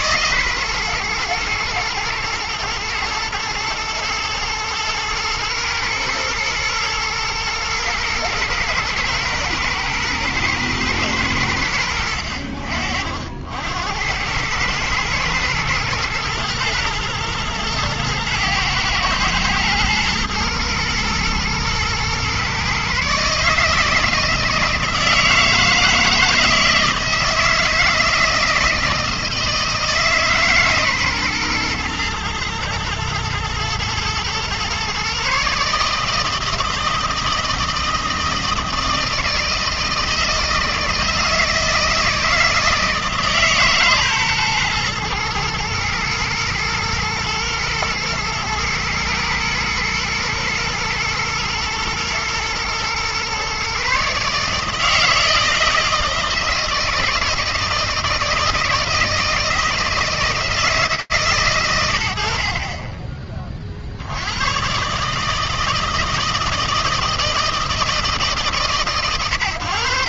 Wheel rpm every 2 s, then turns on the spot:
130, 110, 110, 120, 120, 110, 60, 100, 120, 110, 120, 130, 160, 160, 160, 150, 120, 120, 160, 160, 160, 160, 130, 110, 110, 110, 110, 150, 160, 160, 150, 50, 130, 160, 120.
none